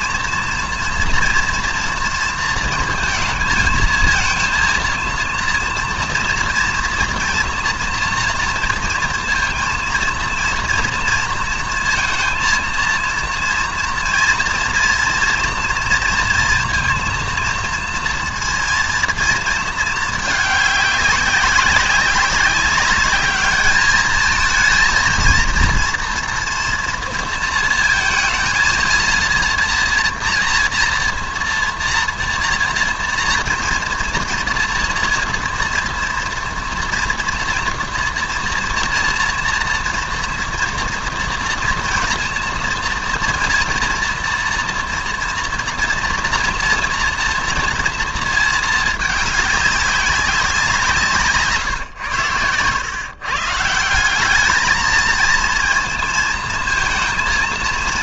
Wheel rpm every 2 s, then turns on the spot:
230, 230, 230, 230, 230, 230, 230, 230, 230, 230, 210, 200, 230, 230, 230, 230, 240, 230, 230, 230, 230, 230, 230, 230, 220, 170, 110, 220, 230.
none